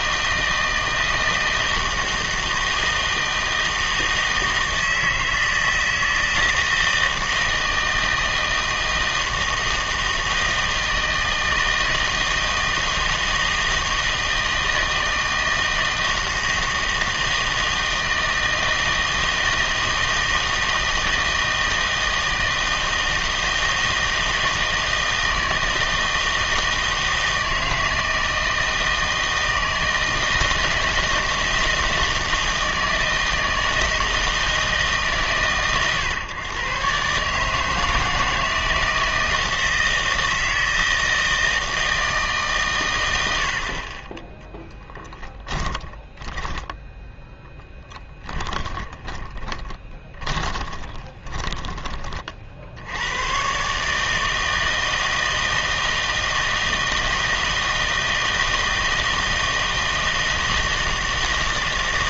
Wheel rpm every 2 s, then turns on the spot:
160, 160, 160, 160, 160, 160, 160, 160, 160, 160, 160, 160, 160, 160, 160, 160, 160, 160, 120, 160, 160, 120, 10, 10, 20, 20, 70, 160, 160, 160, 160.
44-52